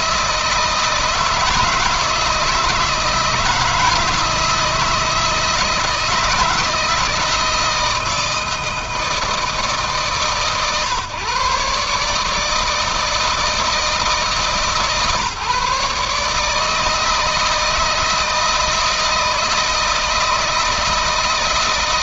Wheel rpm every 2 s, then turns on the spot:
160, 160, 160, 160, 160, 150, 160, 140, 160, 160, 160.
none